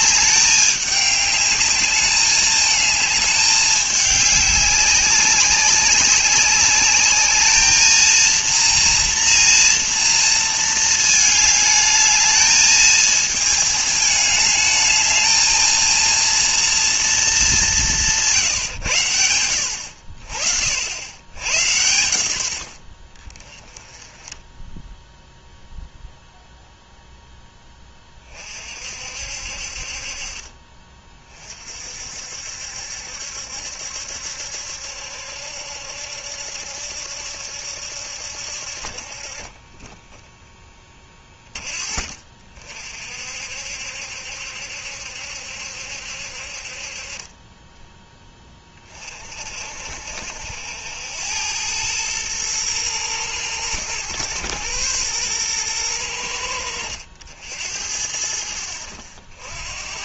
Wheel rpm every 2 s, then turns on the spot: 200, 210, 200, 200, 230, 220, 220, 210, 230, 140, 60, 80, 10, 0, 40, 40, 70, 70, 70, 60, 10, 50, 70, 50, 20, 70, 110, 110, 90, 60.
none